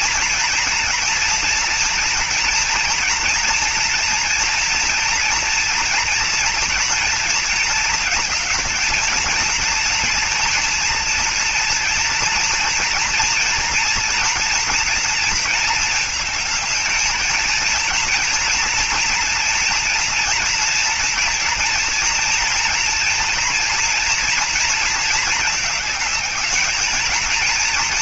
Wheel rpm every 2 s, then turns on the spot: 230, 230, 230, 230, 220, 230, 230, 240, 220, 230, 230, 230, 230, 210.
none